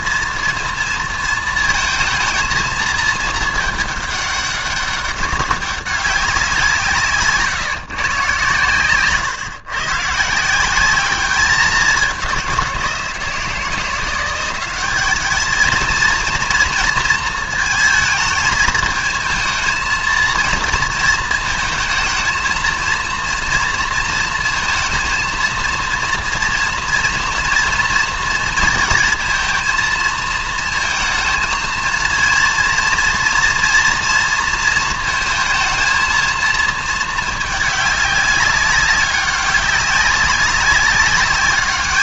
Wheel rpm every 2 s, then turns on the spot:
230, 220, 200, 180, 130, 180, 190, 190, 230, 220, 230, 230, 230, 230, 230, 230, 230, 230, 220, 200, 200.
none